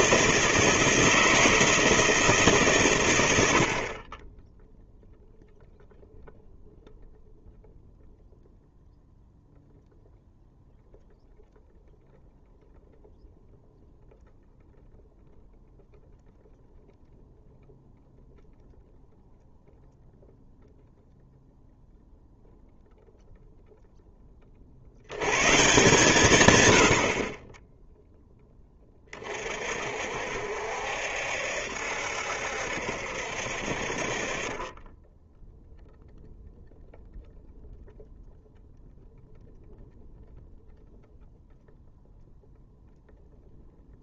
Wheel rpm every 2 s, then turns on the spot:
160, 90, 0, 0, 0, 0, 0, 0, 0, 0, 0, 0, 40, 110, 20, 60, 70, 30, 0, 0, 0, 0.
none